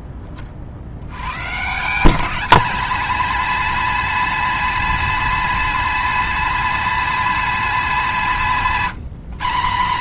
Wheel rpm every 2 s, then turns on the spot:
100, 240, 250, 250, 190.
none